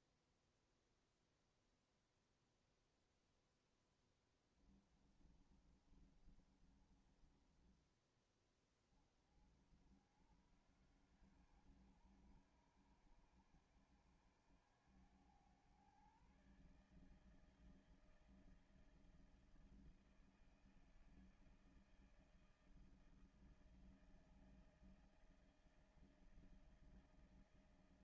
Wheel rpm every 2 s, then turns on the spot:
0, 0, 10, 30, 20, 70, 80, 90, 130, 160, 160, 160, 160, 160.
4-8